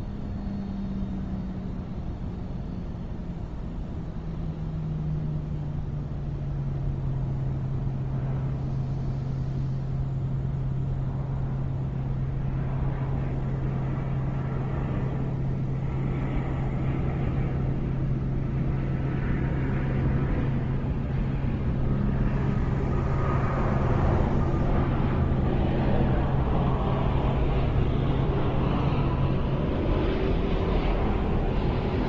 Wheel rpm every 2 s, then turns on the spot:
0, 0, 0, 0, 0, 0, 0, 0, 0, 0, 0, 0, 0, 0, 0, 0.
none